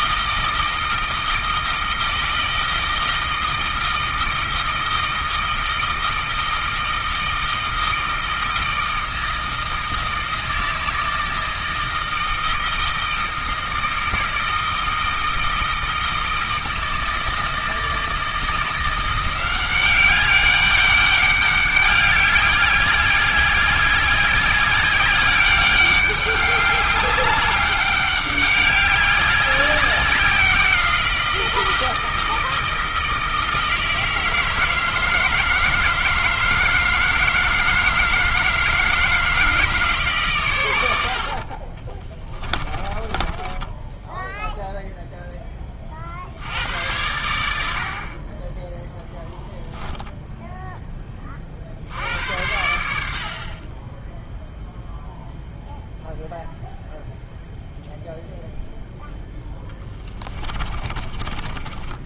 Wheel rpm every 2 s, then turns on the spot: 160, 160, 160, 160, 160, 160, 160, 160, 160, 170, 200, 200, 200, 200, 190, 170, 160, 160, 160, 160, 90, 30, 0, 90, 10, 10, 80, 0, 0, 0, 30.
42-44 60-62